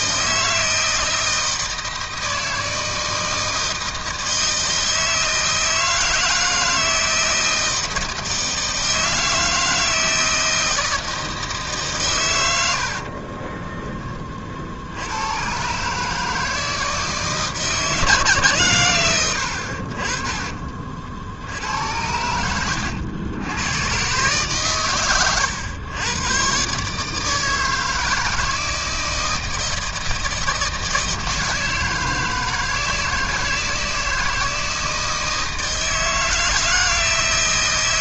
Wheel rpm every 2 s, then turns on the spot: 160, 160, 160, 160, 160, 160, 120, 40, 150, 150, 40, 80, 130, 110, 160, 160, 160, 160, 160.
22-24